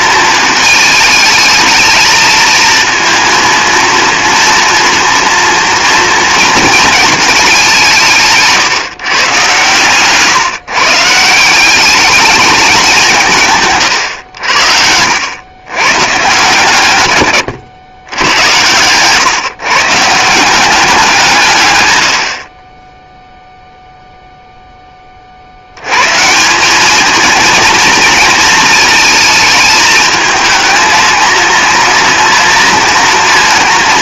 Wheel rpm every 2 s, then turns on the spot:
220, 230, 240, 230, 140, 140, 200, 80, 130, 110, 190, 30, 20, 210, 230, 220, 230.
14-16